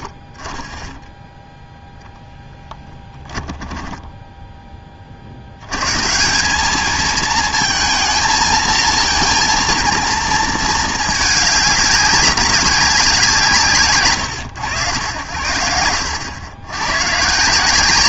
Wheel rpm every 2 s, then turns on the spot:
30, 10, 10, 190, 230, 220, 190, 100, 100.
2-4